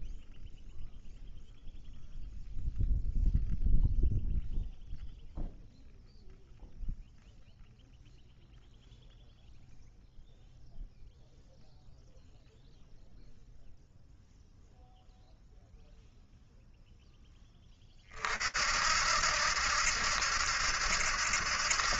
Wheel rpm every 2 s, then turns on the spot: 0, 0, 0, 0, 0, 0, 0, 0, 0, 60, 80.
none